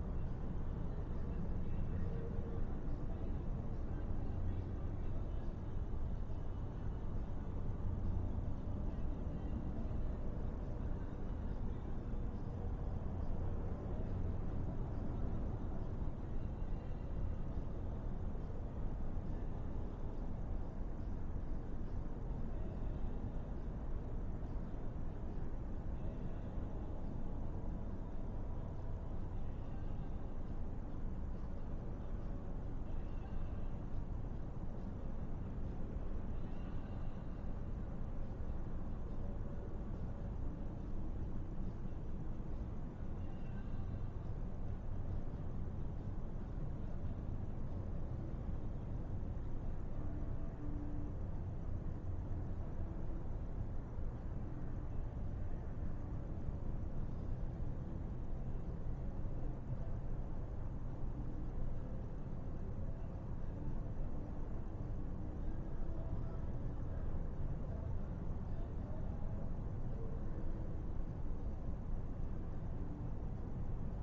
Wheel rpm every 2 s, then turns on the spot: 0, 0, 0, 0, 0, 0, 0, 0, 0, 0, 0, 0, 0, 0, 0, 0, 0, 0, 0, 0, 0, 0, 0, 0, 0, 0, 0, 0, 0, 0, 0, 0, 0, 0, 0, 0, 0.
none